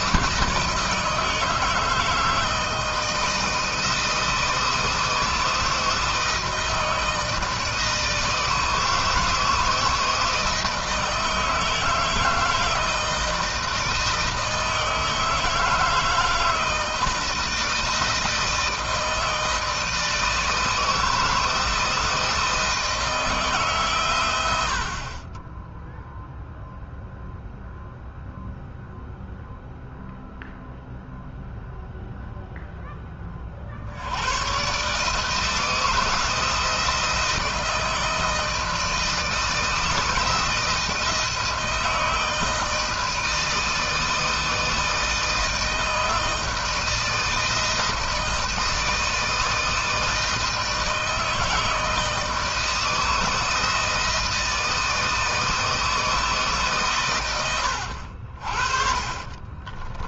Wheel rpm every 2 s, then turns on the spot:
160, 160, 170, 160, 160, 160, 160, 160, 160, 160, 160, 160, 60, 0, 0, 0, 10, 130, 160, 160, 160, 160, 160, 160, 160, 160, 160, 160, 140, 40.
none